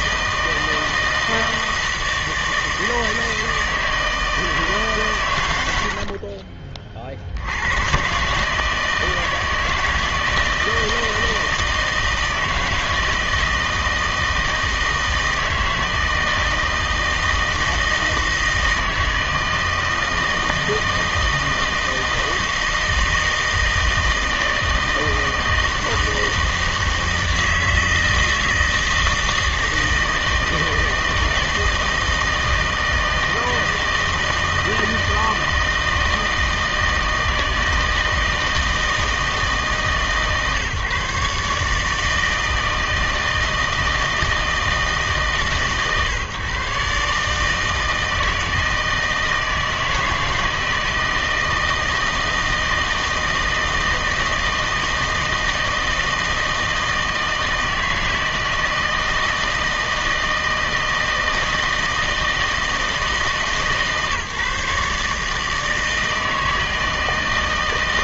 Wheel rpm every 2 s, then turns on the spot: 160, 160, 160, 40, 150, 160, 160, 160, 160, 160, 160, 160, 160, 160, 160, 160, 160, 160, 160, 160, 140, 160, 160, 130, 160, 160, 160, 160, 160, 170, 160, 160, 140, 160.
none